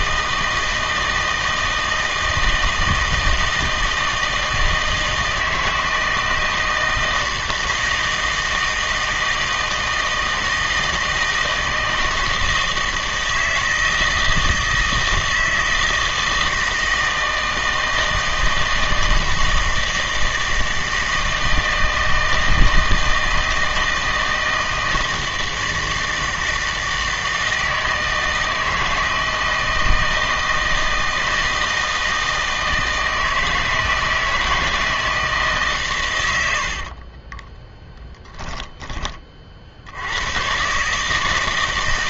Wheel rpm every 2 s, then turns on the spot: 160, 160, 160, 160, 160, 160, 160, 160, 160, 160, 160, 160, 160, 160, 160, 160, 160, 160, 80, 10, 120.
36-40